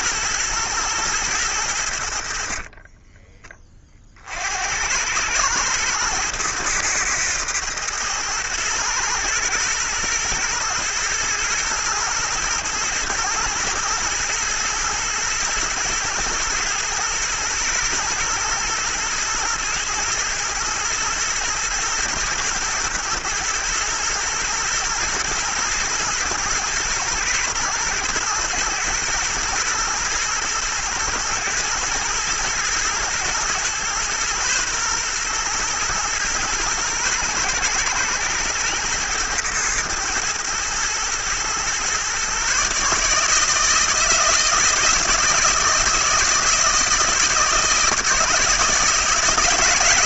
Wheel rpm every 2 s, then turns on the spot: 120, 40, 70, 110, 110, 110, 110, 120, 110, 110, 120, 110, 110, 120, 120, 110, 120, 120, 110, 110, 110, 140, 160, 160, 160.
2-4